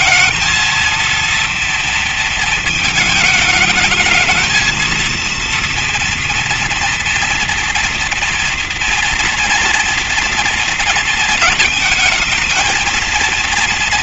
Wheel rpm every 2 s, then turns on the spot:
230, 220, 220, 230, 230, 230, 220.
none